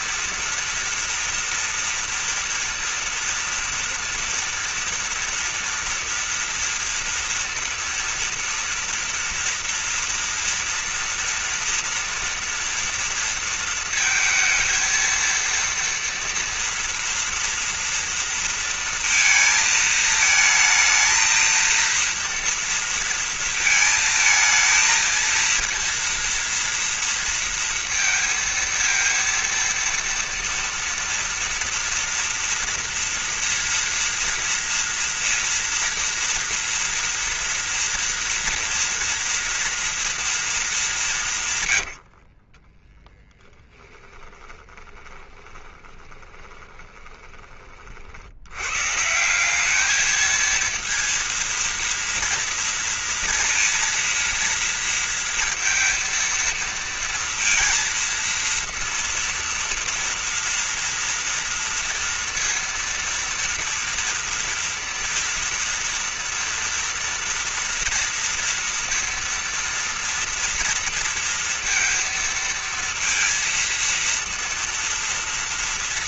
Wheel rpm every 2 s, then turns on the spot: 230, 230, 230, 230, 230, 230, 230, 220, 230, 230, 220, 230, 220, 230, 230, 230, 230, 230, 230, 230, 230, 70, 10, 20, 70, 220, 230, 230, 230, 230, 230, 230, 230, 230, 230, 230, 230, 230.
42-48